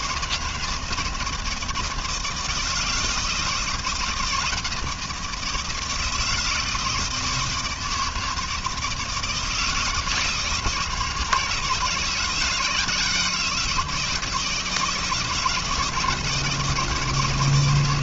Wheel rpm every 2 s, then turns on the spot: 160, 160, 160, 160, 160, 160, 170, 160, 160.
none